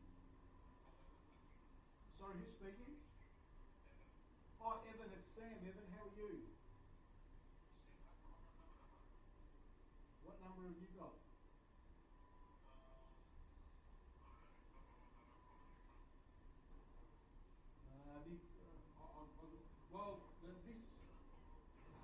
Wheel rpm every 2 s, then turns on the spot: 0, 0, 0, 0, 0, 0, 0, 0, 0, 0, 0.
none